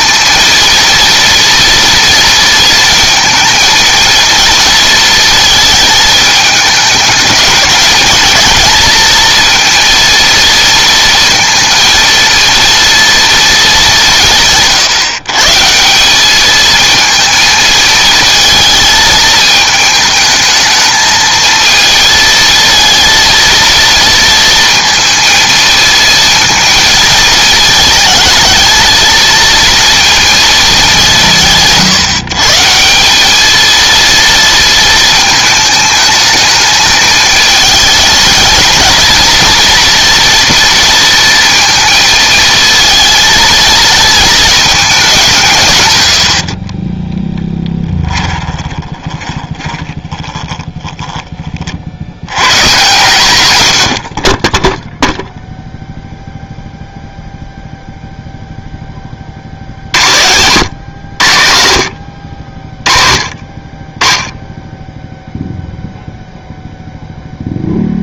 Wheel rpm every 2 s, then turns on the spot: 230, 230, 230, 210, 220, 230, 230, 150, 220, 220, 220, 230, 230, 230, 220, 210, 150, 220, 220, 220, 230, 220, 210, 40, 30, 20, 120, 10, 0, 10, 110, 40, 10, 0.
46-52